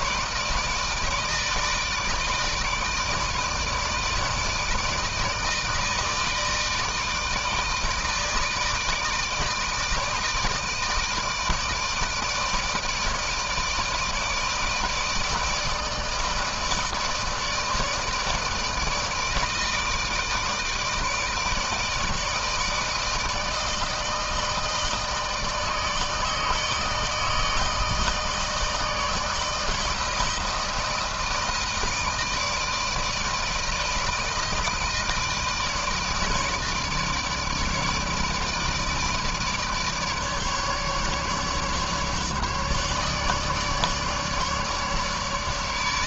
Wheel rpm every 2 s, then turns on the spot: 160, 160, 160, 160, 160, 160, 160, 160, 160, 160, 160, 160, 160, 150, 160, 160, 160, 160, 150, 160, 150, 150, 150.
none